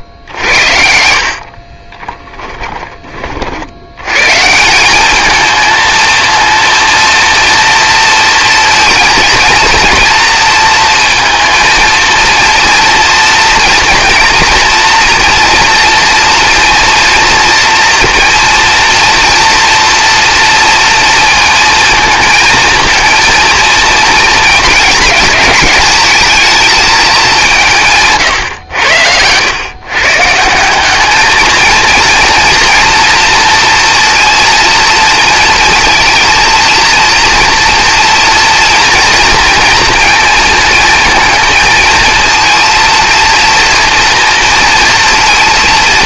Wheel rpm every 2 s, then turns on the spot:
70, 20, 180, 230, 230, 230, 230, 230, 230, 230, 230, 230, 220, 220, 100, 180, 230, 230, 230, 230, 230, 230, 230.
0-2